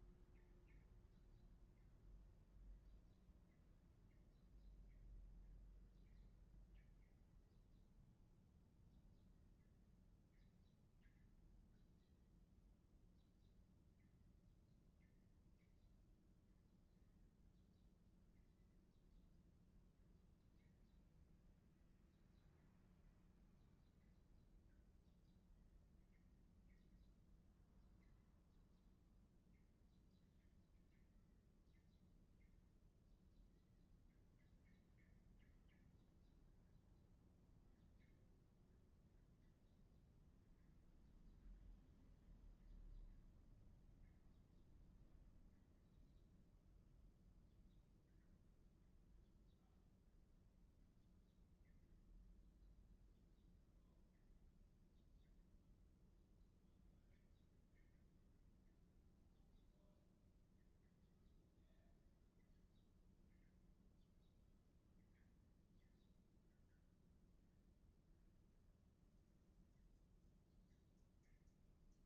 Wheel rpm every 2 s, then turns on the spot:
0, 0, 0, 0, 0, 0, 0, 0, 0, 0, 0, 0, 0, 0, 0, 0, 0, 0, 0, 0, 0, 0, 0, 0, 0, 0, 0, 0, 0, 0, 0, 0, 0, 0, 0, 0.
none